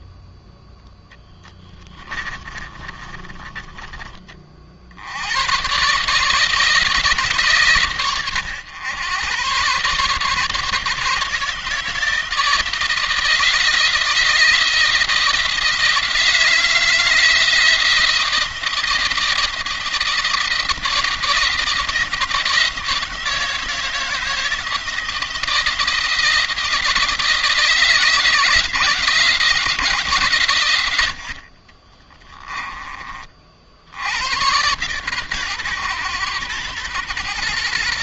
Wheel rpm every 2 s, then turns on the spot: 10, 30, 70, 160, 110, 150, 160, 160, 160, 170, 170, 170, 160, 160, 160, 90, 30, 120, 120.
0-4